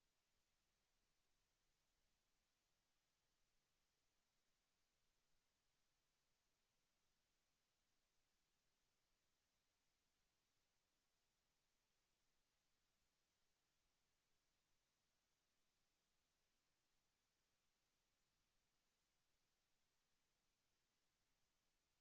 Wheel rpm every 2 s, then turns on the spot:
0, 0, 0, 0, 0, 0, 0, 0, 0, 0, 0.
none